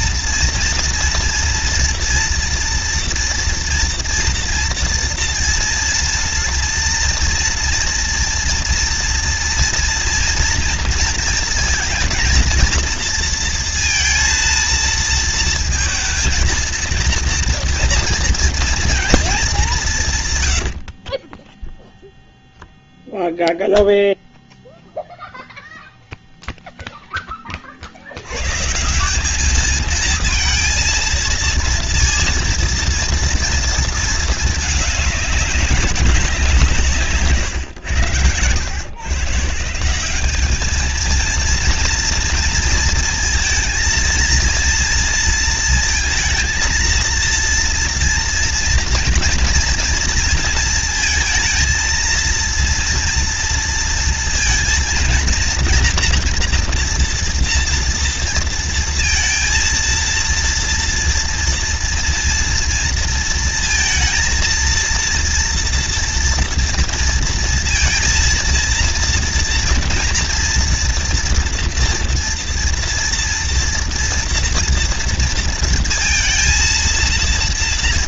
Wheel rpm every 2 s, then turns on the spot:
240, 230, 230, 230, 230, 230, 240, 230, 230, 230, 140, 0, 0, 0, 100, 230, 230, 220, 180, 100, 200, 230, 230, 220, 230, 230, 230, 230, 230, 230, 230, 230, 230, 230, 230, 230, 240, 230, 230.
none